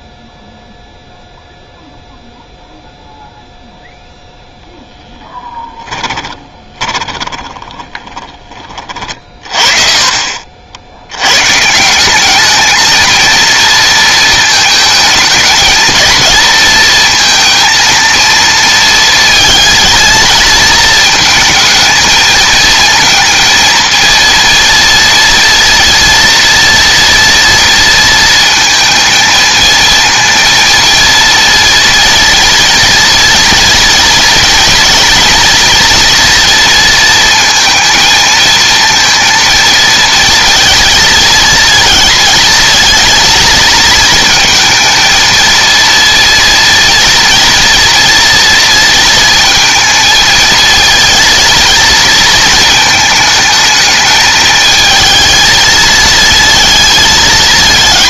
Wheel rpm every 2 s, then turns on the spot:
0, 0, 0, 20, 30, 50, 220, 220, 230, 230, 220, 230, 230, 230, 230, 230, 230, 230, 230, 220, 230, 230, 220, 230, 230, 230, 220, 220, 220.
6-8